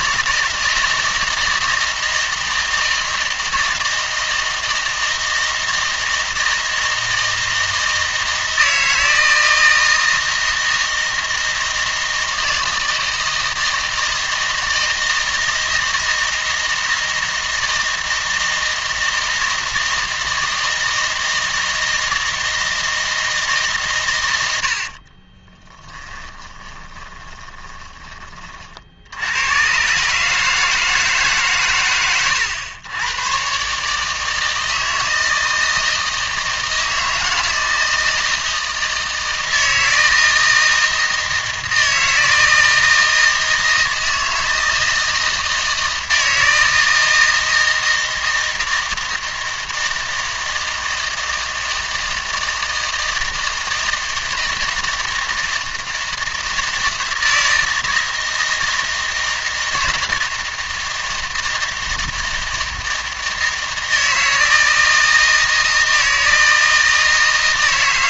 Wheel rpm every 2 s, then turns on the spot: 160, 160, 160, 160, 160, 160, 160, 160, 160, 160, 160, 160, 70, 20, 50, 160, 110, 160, 160, 160, 160, 160, 160, 160, 160, 160, 160, 160, 160, 160, 160, 160, 160, 160.
26-28